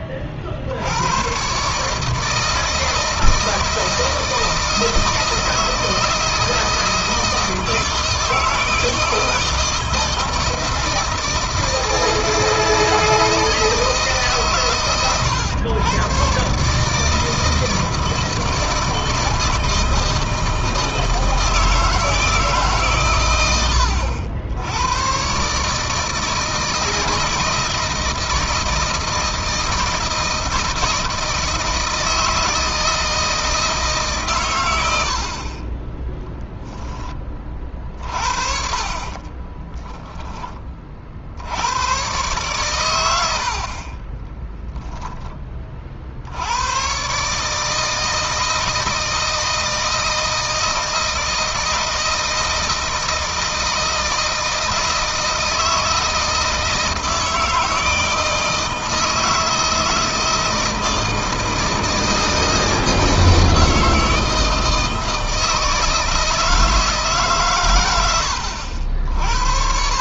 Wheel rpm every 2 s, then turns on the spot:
70, 160, 160, 160, 160, 160, 160, 130, 140, 160, 160, 150, 100, 160, 160, 170, 160, 90, 10, 40, 30, 120, 20, 110, 160, 160, 170, 160, 160, 160, 160, 160, 160, 160, 70.
38-40